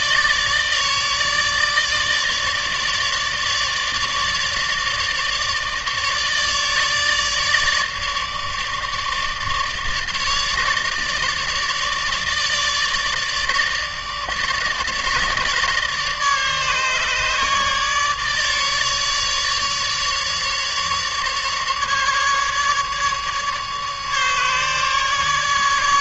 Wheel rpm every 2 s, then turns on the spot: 150, 150, 150, 150, 150, 150, 150, 150, 150, 150, 150, 150, 150.
none